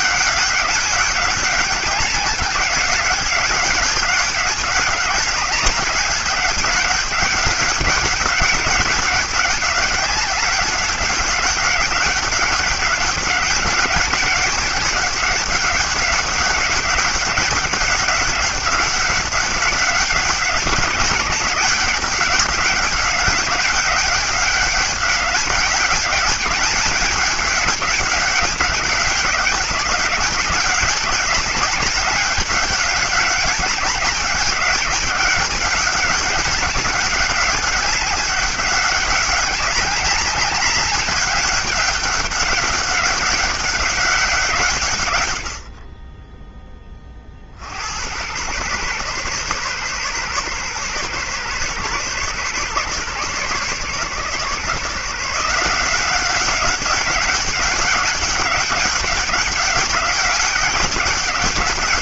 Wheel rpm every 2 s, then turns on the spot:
200, 200, 200, 200, 200, 200, 200, 200, 200, 200, 200, 200, 200, 200, 190, 200, 200, 200, 190, 200, 200, 200, 160, 20, 120, 130, 130, 150, 200, 200, 190.
none